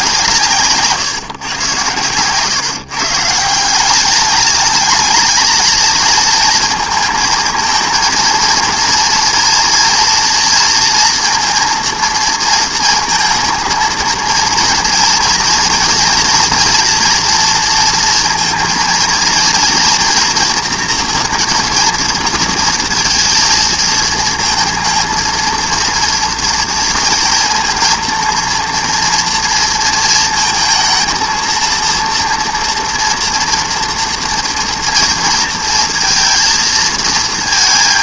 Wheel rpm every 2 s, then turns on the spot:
160, 120, 200, 230, 230, 240, 230, 230, 230, 230, 230, 230, 220, 230, 230, 230, 230, 240, 230.
2-4